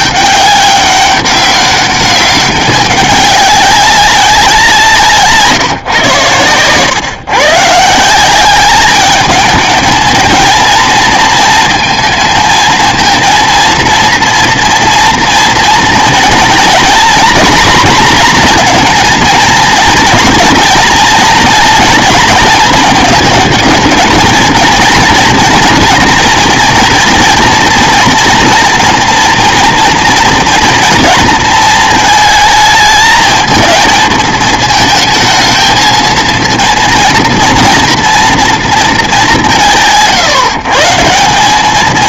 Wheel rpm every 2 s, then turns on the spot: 200, 200, 170, 120, 200, 220, 230, 230, 230, 240, 230, 220, 230, 230, 230, 230, 220, 220, 230, 230, 160.
none